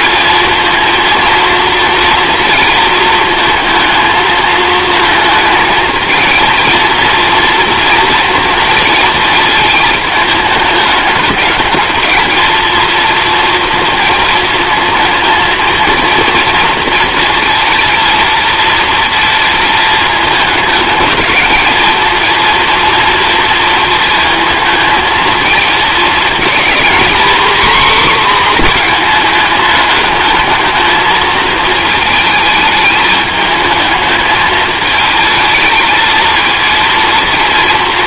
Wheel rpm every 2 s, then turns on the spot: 230, 230, 220, 230, 230, 210, 230, 220, 230, 230, 220, 230, 220, 230, 230, 220, 220, 220, 230.
none